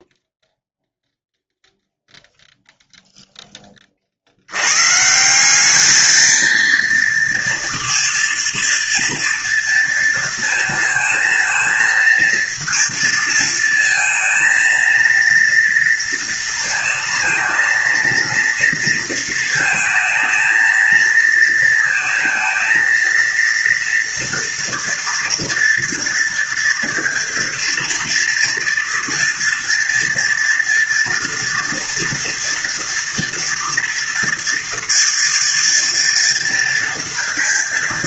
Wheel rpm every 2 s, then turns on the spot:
0, 0, 140, 230, 230, 230, 230, 230, 230, 230, 230, 230, 230, 230, 230, 230, 230, 230, 230.
none